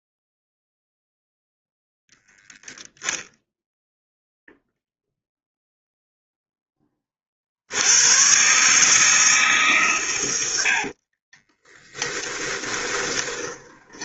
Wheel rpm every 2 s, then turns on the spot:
0, 10, 0, 20, 140, 60, 20.
10-14